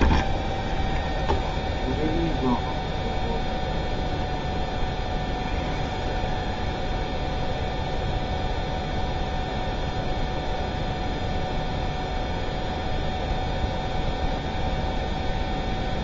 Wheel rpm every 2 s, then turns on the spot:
0, 0, 0, 0, 0, 0, 0, 0.
none